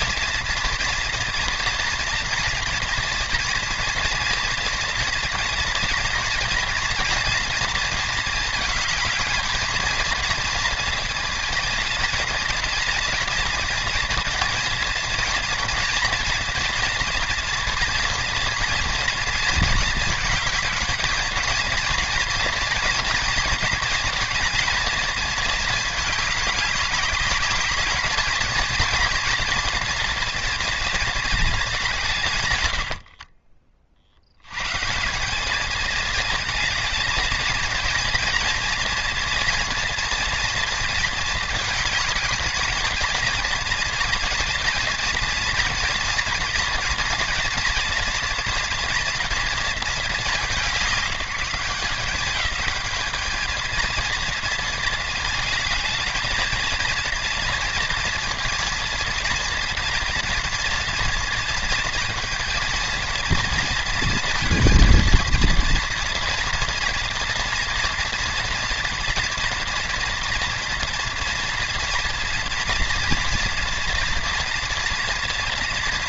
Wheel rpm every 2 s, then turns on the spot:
240, 230, 230, 230, 220, 230, 230, 230, 230, 230, 210, 230, 230, 200, 230, 230, 90, 150, 220, 230, 230, 230, 230, 240, 240, 190, 210, 230, 230, 230, 230, 230, 230, 230, 230, 230, 230, 230.
32-34